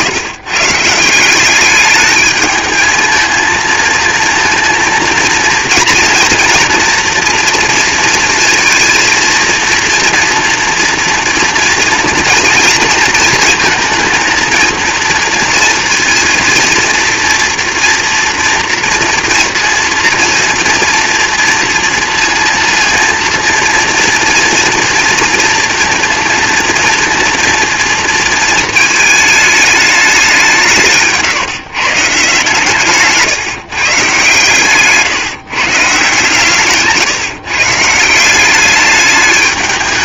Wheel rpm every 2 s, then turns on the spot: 140, 220, 230, 240, 230, 230, 230, 230, 230, 230, 230, 230, 230, 230, 220, 180, 140, 140, 130, 190.
34-36